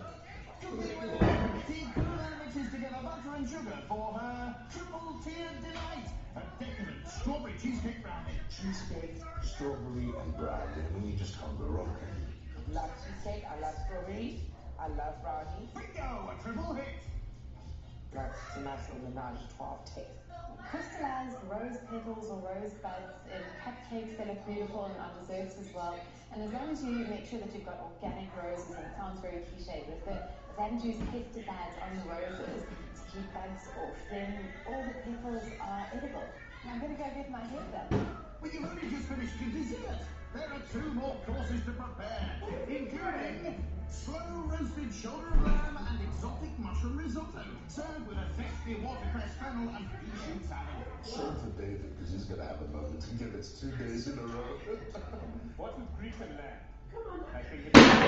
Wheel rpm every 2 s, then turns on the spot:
0, 0, 0, 0, 0, 0, 0, 0, 0, 0, 0, 0, 0, 0, 0, 0, 0, 0, 0, 0, 0, 0, 0, 0, 0, 0, 0, 0, 0.
none